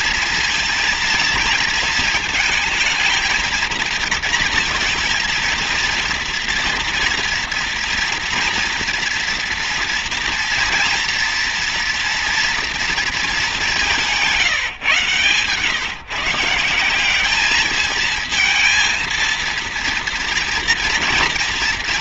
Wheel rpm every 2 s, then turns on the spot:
230, 220, 230, 230, 230, 230, 220, 140, 190, 230, 230.
none